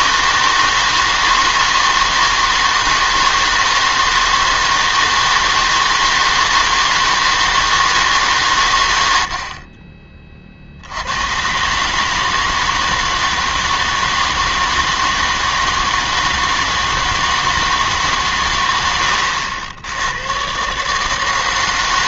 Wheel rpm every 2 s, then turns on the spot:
160, 160, 160, 160, 130, 60, 160, 160, 160, 110, 130.
none